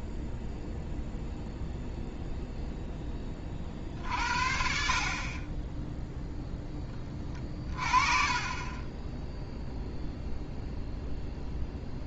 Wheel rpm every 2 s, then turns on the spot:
0, 0, 60, 10, 20, 0.
none